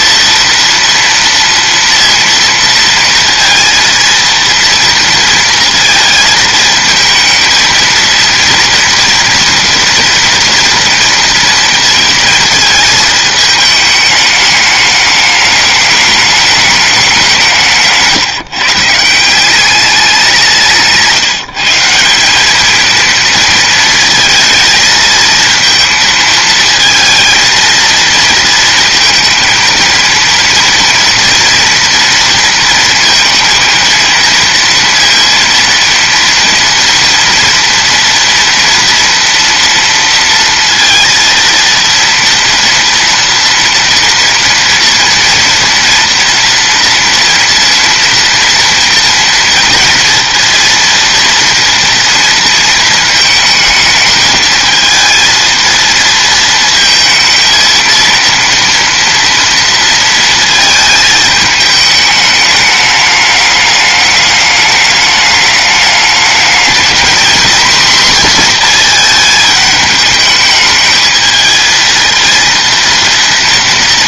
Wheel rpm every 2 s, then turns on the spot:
240, 230, 230, 220, 230, 230, 220, 210, 210, 160, 170, 210, 220, 220, 230, 230, 230, 230, 230, 230, 230, 230, 230, 230, 230, 230, 230, 220, 220, 240, 220, 210, 210, 220, 240, 210, 230.
none